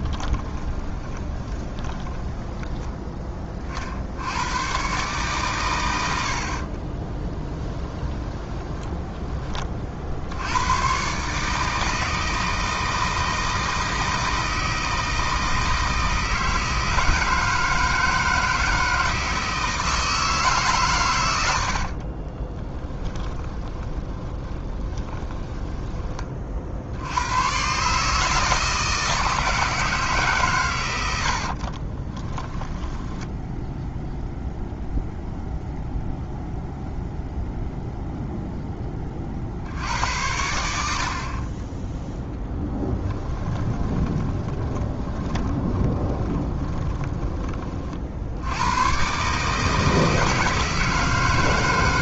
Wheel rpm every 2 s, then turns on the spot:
20, 20, 120, 30, 20, 110, 160, 160, 160, 160, 130, 20, 20, 60, 160, 120, 10, 0, 0, 10, 80, 10, 20, 20, 100, 160.
0-4 6-10 22-26 32-34 42-48